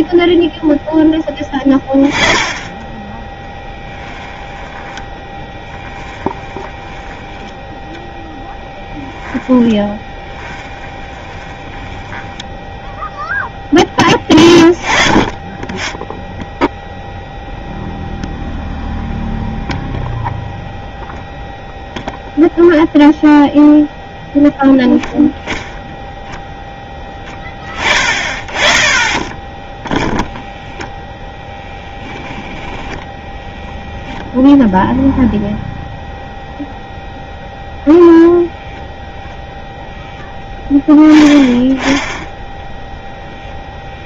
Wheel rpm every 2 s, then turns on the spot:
0, 10, 10, 10, 10, 20, 10, 20, 0, 0, 0, 0, 0, 0, 30, 0, 10, 0, 0, 0, 10, 0.
4-14